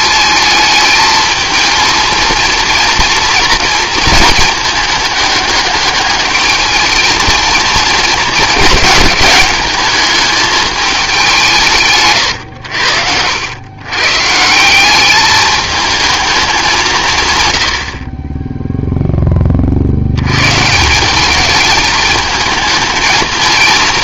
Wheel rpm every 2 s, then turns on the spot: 220, 230, 210, 210, 210, 210, 80, 170, 190, 0, 130, 220.
none